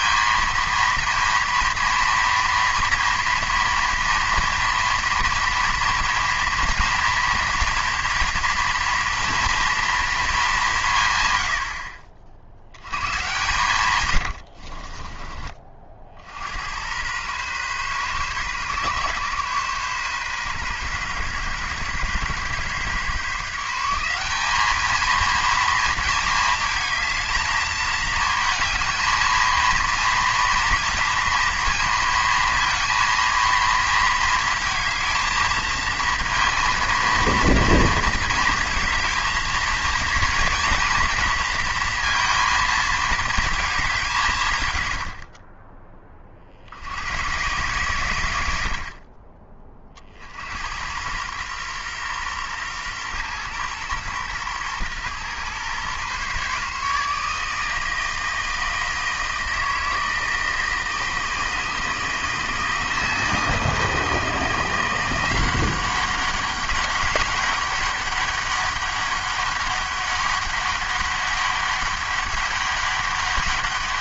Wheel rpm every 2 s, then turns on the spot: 230, 230, 230, 240, 230, 180, 80, 40, 90, 130, 130, 130, 210, 220, 220, 230, 230, 220, 230, 220, 230, 230, 110, 70, 70, 90, 120, 120, 140, 160, 160, 160, 170, 190, 200, 200, 200.
14-16 48-50